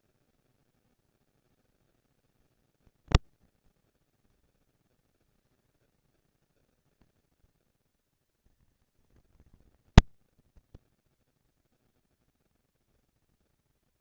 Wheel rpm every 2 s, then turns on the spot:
230, 220, 230, 230, 230, 240, 230.
none